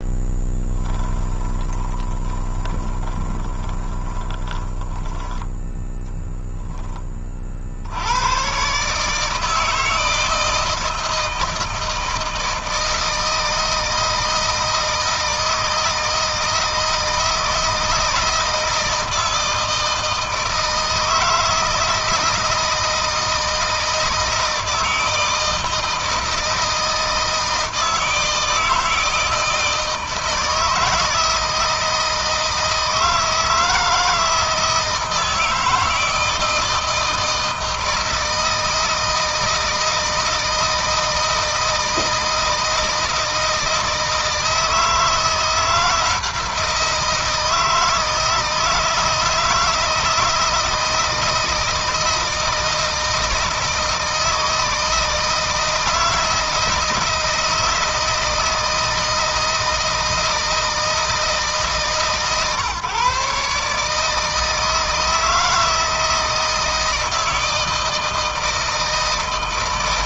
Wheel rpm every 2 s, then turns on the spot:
10, 20, 20, 10, 140, 160, 160, 160, 160, 160, 160, 160, 160, 160, 160, 160, 160, 160, 170, 160, 160, 160, 170, 160, 160, 160, 160, 160, 160, 160, 160, 140, 160, 160, 160.
0-6